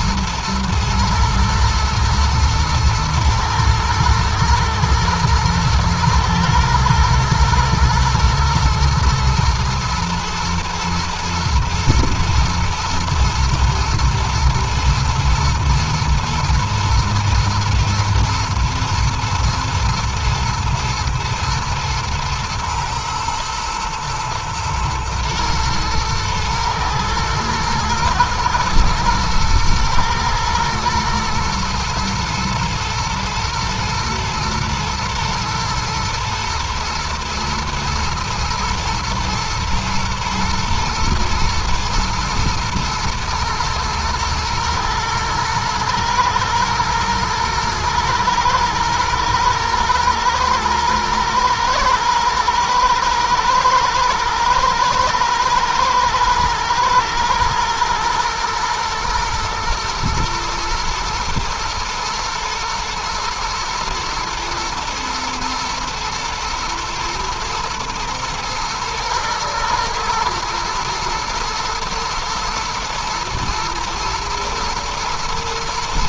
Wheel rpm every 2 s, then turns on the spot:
120, 110, 110, 110, 110, 110, 110, 110, 120, 110, 120, 110, 120, 110, 120, 120, 120, 120, 120, 110, 110, 120, 120, 110, 120, 120, 110, 110, 110, 120, 110, 120, 120, 110, 110, 110, 120, 120.
none